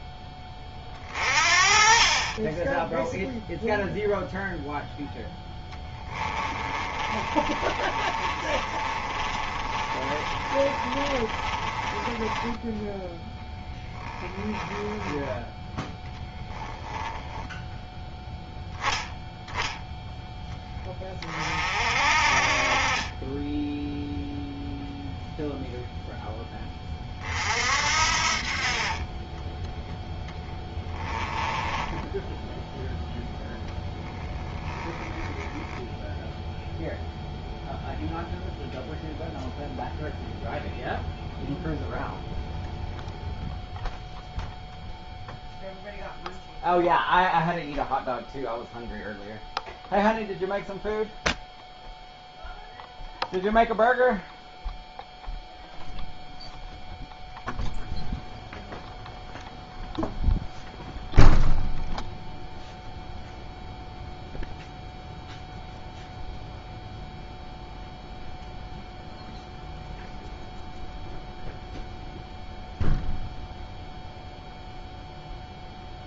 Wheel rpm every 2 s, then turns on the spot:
30, 0, 0, 30, 30, 30, 10, 10, 10, 10, 20, 20, 0, 20, 30, 10, 0, 10, 0, 0, 0, 0, 0, 0, 0, 0, 0, 0, 0, 0, 0, 0, 0, 0, 0, 0, 0, 0.
6-12 14-16 30-32 34-36